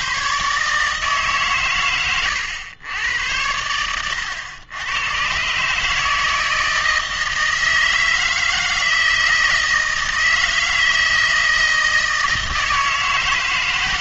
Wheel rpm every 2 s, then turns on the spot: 140, 100, 90, 160, 160, 160, 160.
none